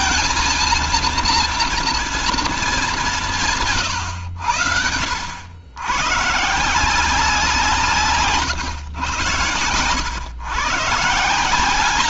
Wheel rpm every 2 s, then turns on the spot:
230, 210, 90, 160, 130, 140.
none